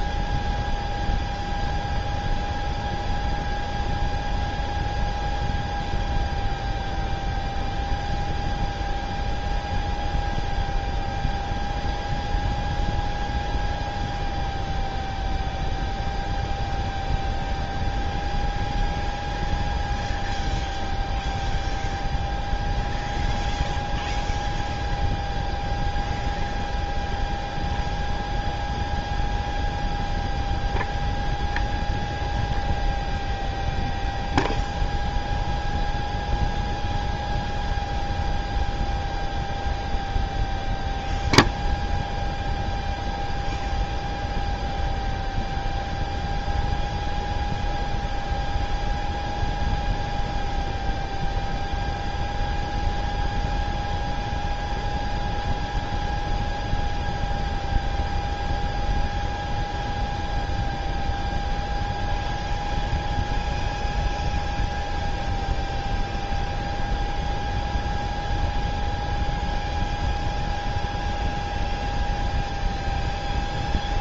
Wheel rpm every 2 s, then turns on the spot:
0, 0, 0, 0, 0, 0, 0, 0, 0, 0, 0, 0, 0, 0, 0, 0, 0, 0, 0, 0, 0, 0, 0, 0, 0, 0, 0, 0, 0, 0, 0, 0, 0, 0, 0, 0, 0.
none